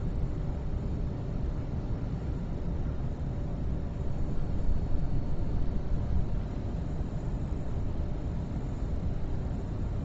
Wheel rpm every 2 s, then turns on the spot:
0, 0, 0, 0, 0.
none